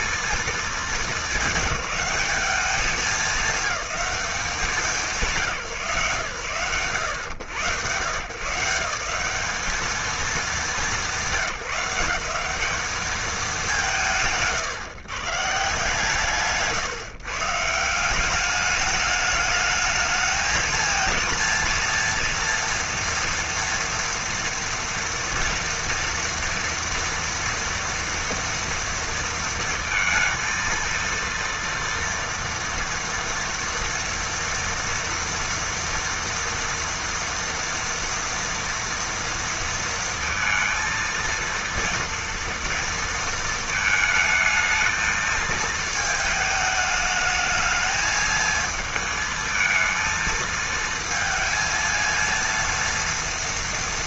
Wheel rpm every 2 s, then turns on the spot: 210, 200, 200, 110, 160, 180, 210, 120, 130, 200, 220, 230, 230, 230, 230, 230, 230, 230, 230, 230, 230, 230, 220, 220, 220, 230, 230.
none